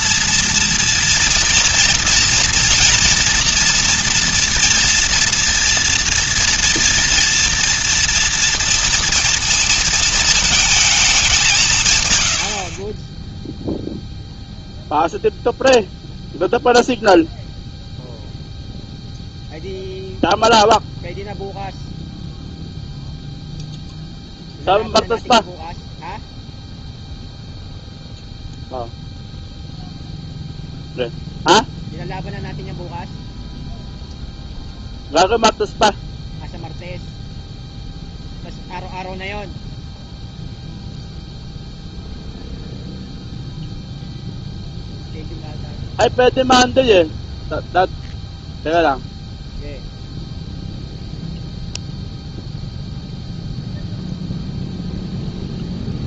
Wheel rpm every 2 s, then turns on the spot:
230, 230, 230, 230, 230, 220, 60, 0, 0, 0, 0, 0, 0, 0, 0, 0, 0, 0, 0, 0, 0, 0, 0, 0, 0, 0, 0, 0.
none